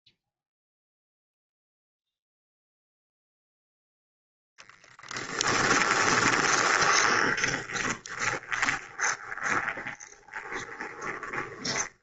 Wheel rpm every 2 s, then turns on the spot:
0, 0, 10, 20, 20, 20.
4-12